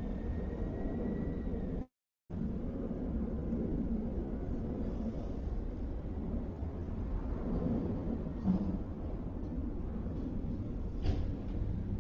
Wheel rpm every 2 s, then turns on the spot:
0, 0, 0, 0, 0, 0.
none